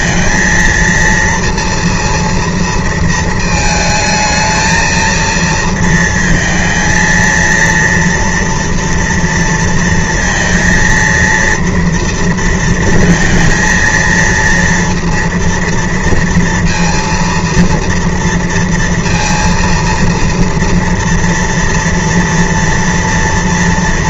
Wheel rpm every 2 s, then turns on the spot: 230, 230, 220, 230, 230, 230, 230, 230, 230, 230, 230, 230.
none